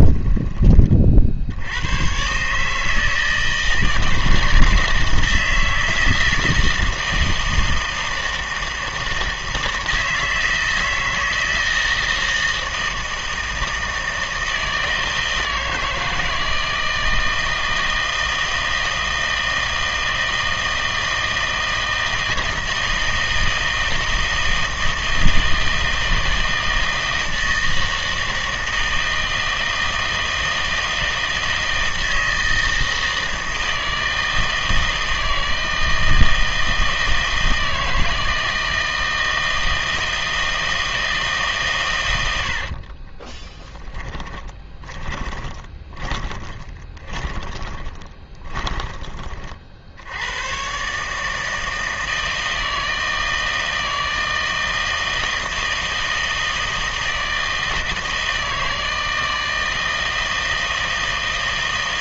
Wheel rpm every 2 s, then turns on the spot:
20, 140, 160, 160, 160, 160, 160, 160, 160, 160, 160, 160, 160, 160, 160, 160, 160, 160, 160, 160, 160, 60, 10, 20, 20, 120, 160, 160, 160, 160, 160.
42-50